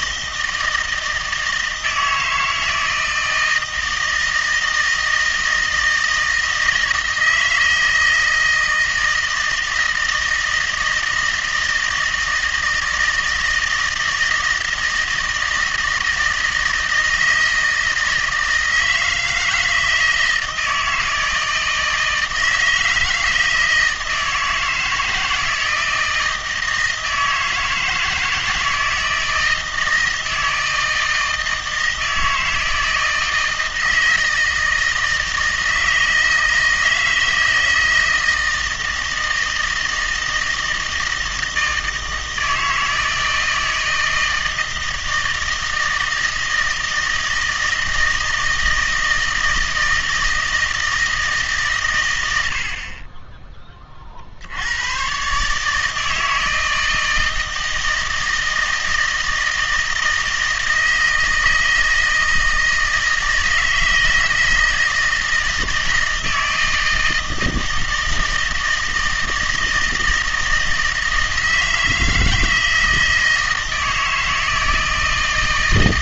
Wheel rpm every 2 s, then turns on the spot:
160, 160, 160, 160, 160, 160, 160, 160, 160, 160, 160, 160, 160, 160, 160, 160, 160, 160, 160, 160, 160, 160, 160, 160, 160, 160, 60, 90, 160, 160, 160, 160, 160, 160, 160, 160, 160, 160.
none